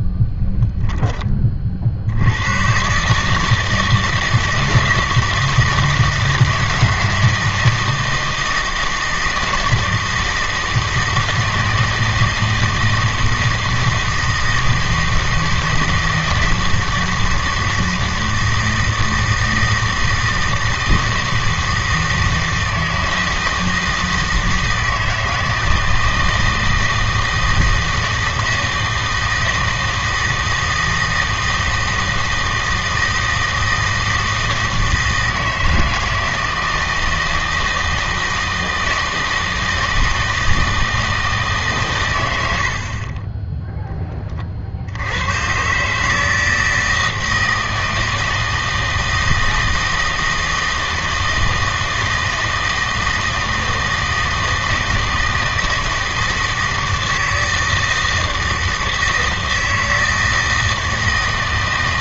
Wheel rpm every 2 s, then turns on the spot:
0, 120, 160, 160, 160, 160, 160, 160, 160, 160, 160, 160, 160, 160, 160, 160, 160, 160, 160, 160, 160, 80, 50, 160, 160, 160, 160, 160, 160, 160, 160.
none